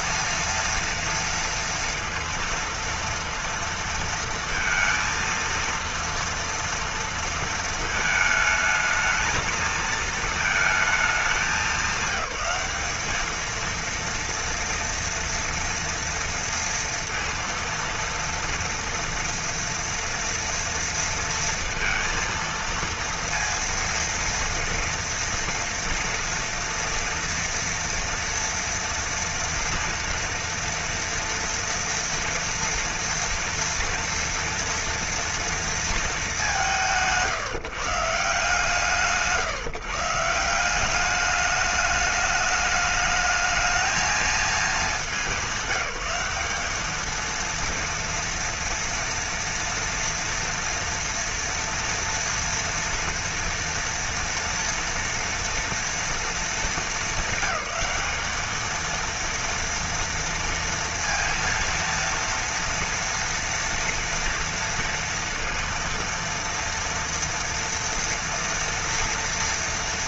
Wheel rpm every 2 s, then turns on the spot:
230, 230, 230, 230, 220, 220, 200, 230, 230, 230, 230, 230, 230, 230, 230, 230, 230, 230, 210, 150, 160, 210, 220, 200, 230, 230, 230, 230, 230, 210, 230, 230, 240, 230, 230.
none